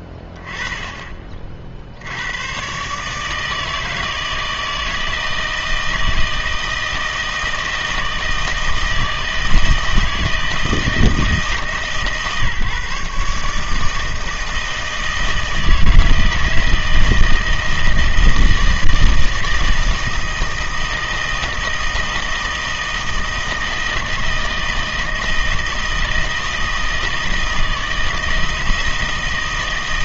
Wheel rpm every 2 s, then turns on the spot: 10, 120, 160, 160, 160, 160, 150, 160, 160, 160, 160, 160, 160, 160, 160.
none